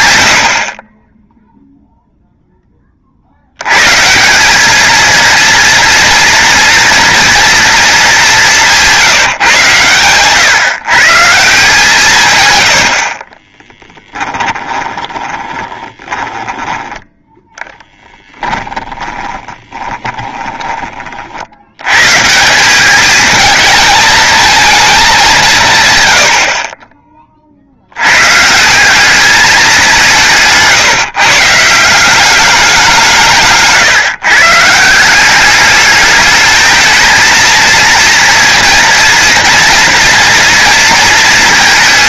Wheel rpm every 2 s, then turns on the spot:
40, 20, 210, 230, 180, 140, 90, 20, 20, 10, 20, 190, 220, 40, 180, 150, 190, 150, 220, 230, 230.
14-20